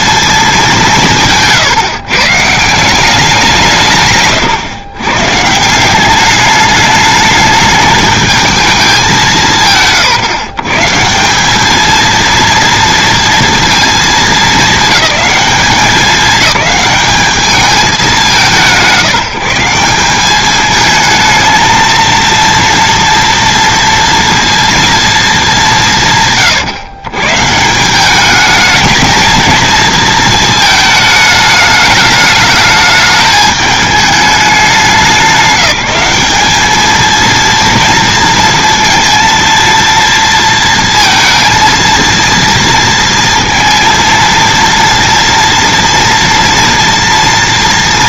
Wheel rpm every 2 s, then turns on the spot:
190, 170, 130, 210, 210, 130, 230, 220, 210, 150, 210, 230, 230, 130, 220, 220, 210, 190, 220, 230, 230, 230, 230, 230.
none